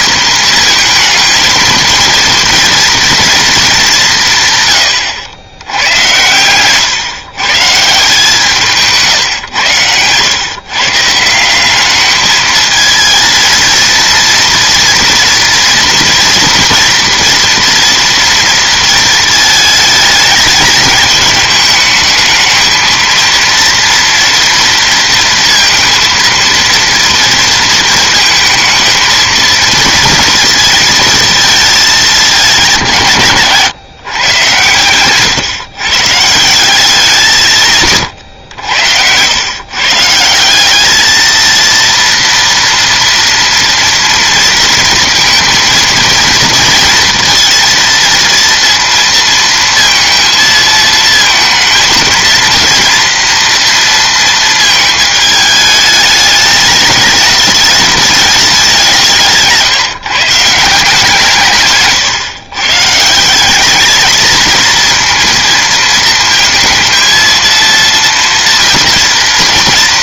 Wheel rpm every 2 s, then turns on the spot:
230, 230, 120, 120, 140, 130, 220, 230, 240, 220, 210, 230, 230, 230, 220, 230, 190, 120, 180, 90, 190, 230, 230, 230, 230, 220, 230, 220, 210, 190, 160, 130, 230, 230, 230.
none